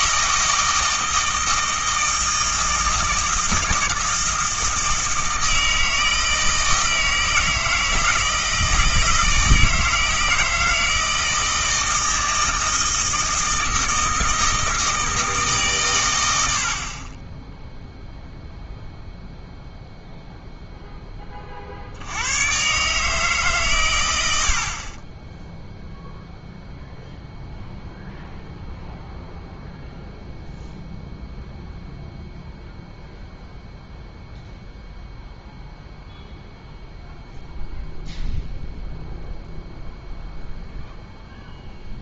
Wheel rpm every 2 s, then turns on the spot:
160, 160, 160, 160, 160, 160, 160, 160, 50, 0, 0, 130, 50, 0, 0, 0, 0, 0, 0, 0, 0.
none